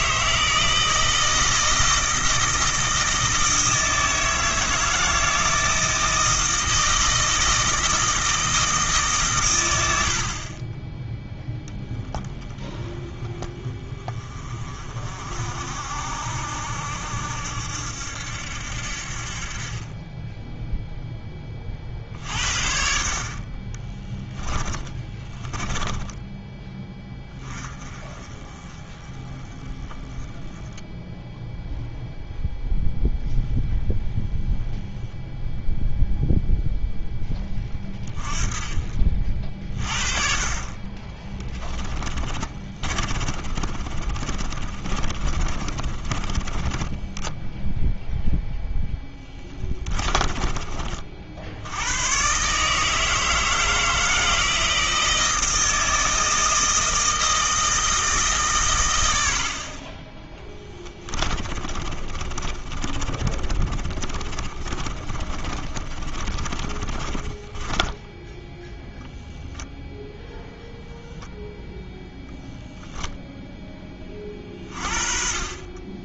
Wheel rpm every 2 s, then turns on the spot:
160, 160, 160, 160, 160, 20, 10, 30, 70, 70, 0, 60, 10, 10, 20, 10, 0, 0, 0, 30, 30, 30, 30, 20, 0, 30, 140, 170, 160, 120, 10, 30, 30, 30, 10, 0, 0, 40.
24-26 42-48 50-52 60-68